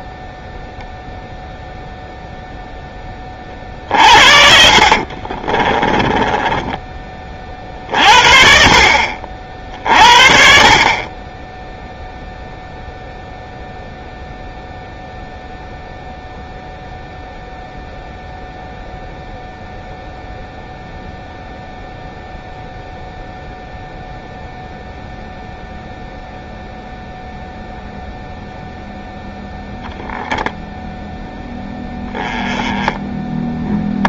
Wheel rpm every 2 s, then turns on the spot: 0, 10, 50, 20, 50, 50, 0, 0, 0, 0, 0, 0, 0, 0, 0, 0, 10.
4-6